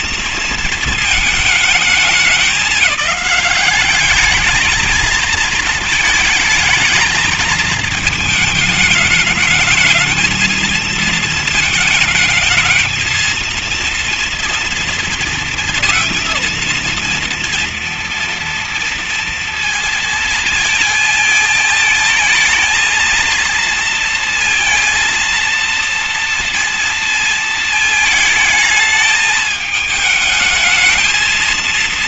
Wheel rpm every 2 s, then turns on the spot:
230, 210, 210, 220, 210, 220, 220, 230, 230, 240, 230, 220, 230, 230, 220, 220.
none